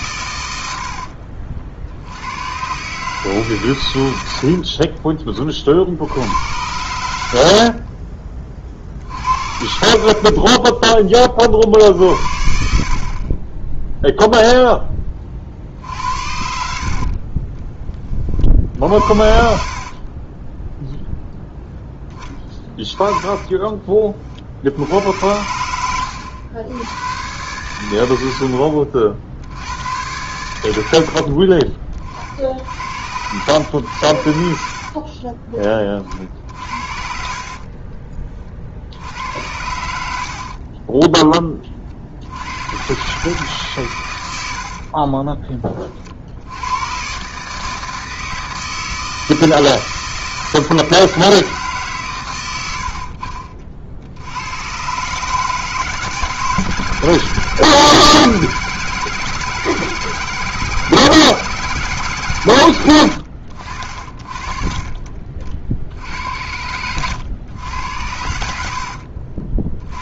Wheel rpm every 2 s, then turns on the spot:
90, 120, 60, 90, 40, 20, 60, 0, 60, 50, 10, 10, 60, 100, 70, 100, 70, 60, 60, 60, 40, 90, 100, 80, 160, 160, 90, 100, 150, 160, 160, 120, 30, 80, 70.
4-6 10-12 16-20 22-24 40-42 44-46 52-54 64-66